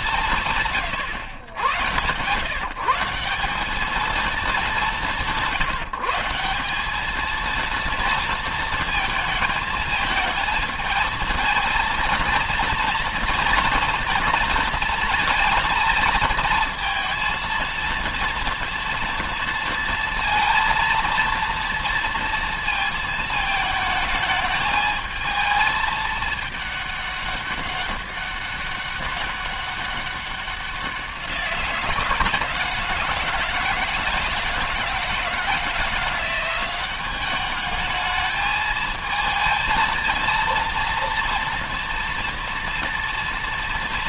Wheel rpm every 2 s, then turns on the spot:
150, 160, 210, 200, 230, 220, 230, 230, 220, 230, 230, 230, 220, 210, 200, 190, 160, 160, 180, 220, 230, 230.
none